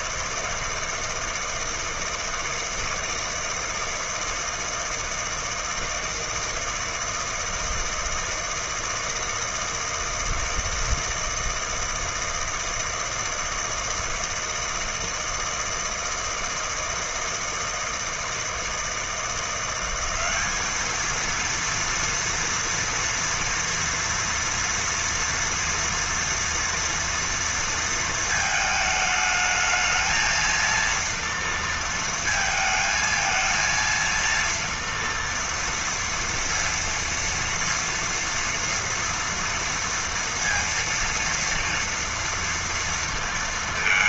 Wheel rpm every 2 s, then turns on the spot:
160, 160, 160, 160, 160, 160, 160, 160, 160, 170, 220, 230, 230, 230, 220, 230, 220, 230, 230, 230, 230, 230.
none